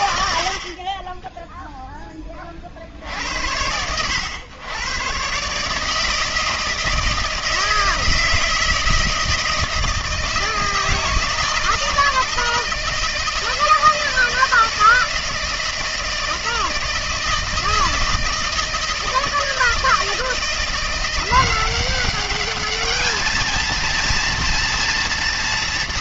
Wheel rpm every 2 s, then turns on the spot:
40, 120, 160, 160, 160, 160, 160, 160, 160, 170, 210, 230, 230.
none